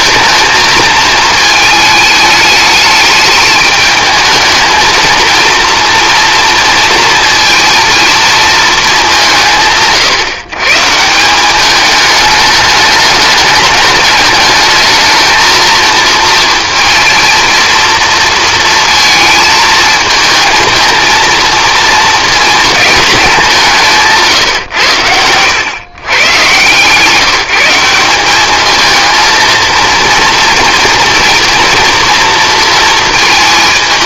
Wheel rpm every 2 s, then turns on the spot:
220, 210, 230, 240, 210, 150, 210, 210, 230, 230, 220, 220, 130, 130, 220, 230, 230.
none